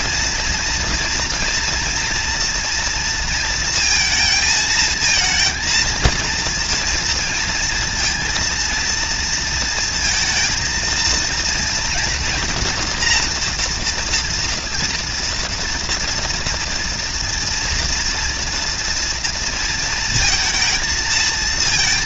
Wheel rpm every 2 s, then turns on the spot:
230, 230, 220, 230, 230, 230, 240, 230, 230, 230, 230.
none